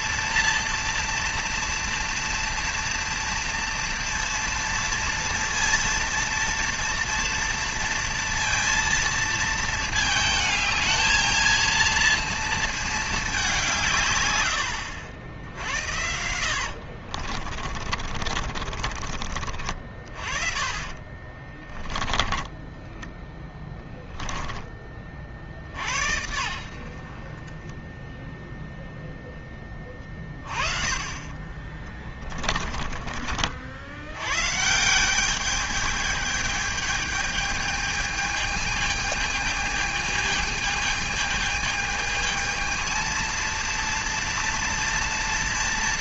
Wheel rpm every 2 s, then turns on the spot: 230, 230, 230, 230, 230, 220, 210, 80, 70, 40, 40, 10, 20, 60, 0, 30, 30, 160, 210, 220, 220, 220, 230.
16-24 32-34